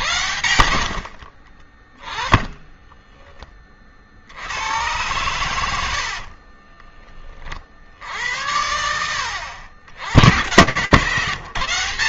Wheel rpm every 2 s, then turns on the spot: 70, 10, 70, 40, 80, 130.
2-4 6-8 10-12